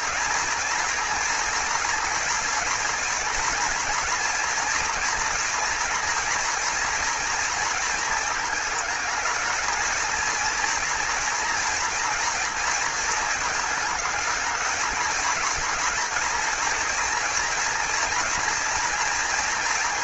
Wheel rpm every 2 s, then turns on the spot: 240, 230, 230, 230, 220, 230, 220, 220, 230, 230.
none